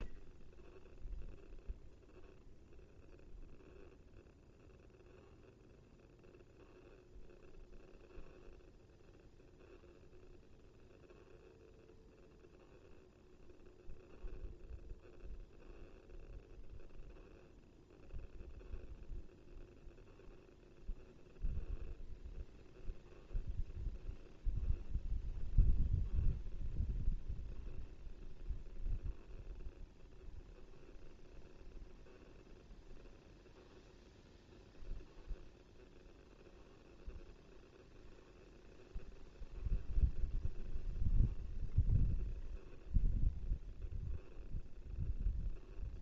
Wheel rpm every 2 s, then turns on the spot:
0, 0, 0, 0, 0, 0, 0, 0, 0, 0, 0, 0, 0, 0, 0, 0, 0, 0, 0, 0, 0, 0, 0.
none